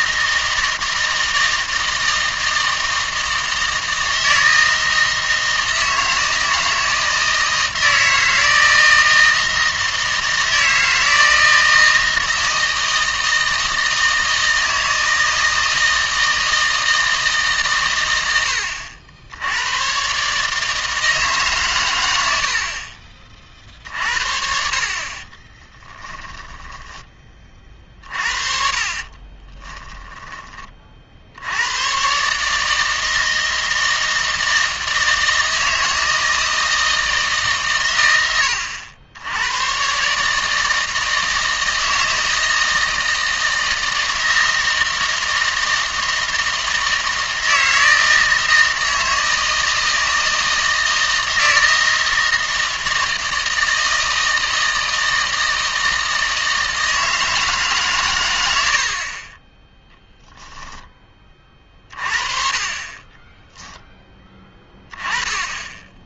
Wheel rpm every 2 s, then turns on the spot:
160, 160, 160, 160, 160, 160, 160, 160, 160, 80, 150, 60, 50, 10, 40, 20, 150, 160, 160, 90, 150, 160, 160, 160, 160, 160, 160, 160, 160, 80, 0, 30, 10.
26-28